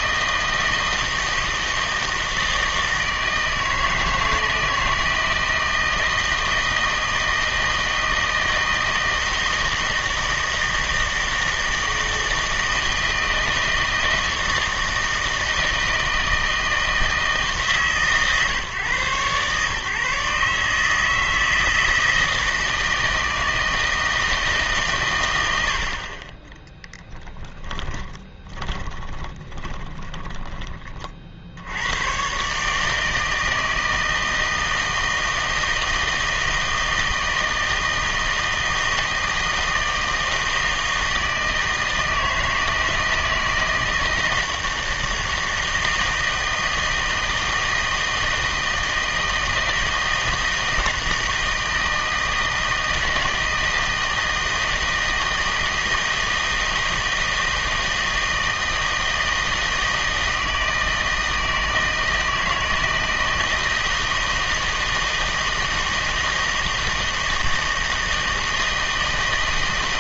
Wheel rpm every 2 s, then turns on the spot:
160, 160, 160, 160, 160, 160, 160, 160, 160, 130, 150, 160, 140, 10, 20, 20, 150, 160, 160, 160, 160, 160, 160, 160, 160, 160, 160, 160, 160, 160, 160, 160, 160, 160, 160.
28-30